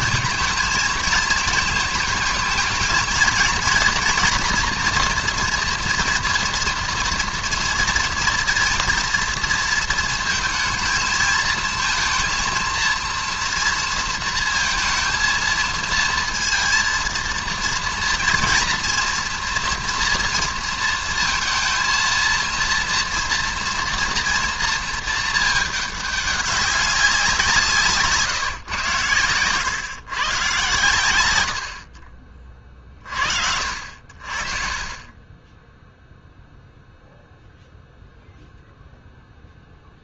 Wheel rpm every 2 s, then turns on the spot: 220, 220, 240, 230, 230, 230, 230, 230, 230, 240, 230, 230, 230, 200, 120, 130, 40, 40, 0, 0.
none